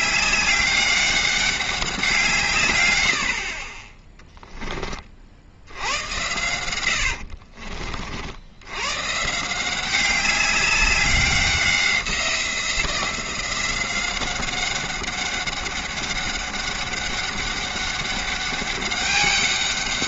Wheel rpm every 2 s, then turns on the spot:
200, 130, 20, 90, 90, 200, 180, 190, 200, 200.
6-8